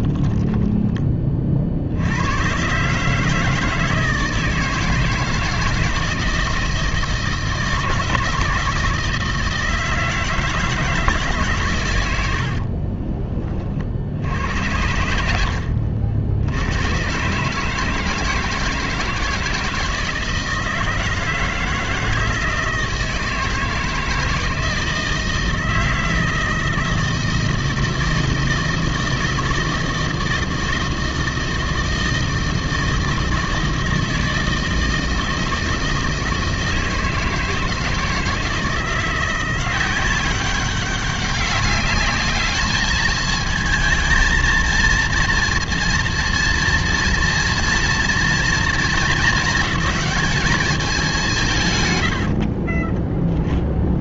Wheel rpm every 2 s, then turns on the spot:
10, 120, 160, 160, 160, 160, 70, 80, 80, 160, 160, 160, 160, 160, 160, 160, 160, 160, 160, 160, 190, 210, 230, 230, 230, 220, 50.
0-2 12-14 52-54